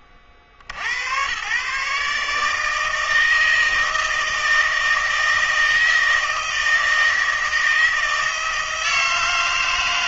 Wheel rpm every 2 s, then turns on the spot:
70, 160, 160, 160, 160.
none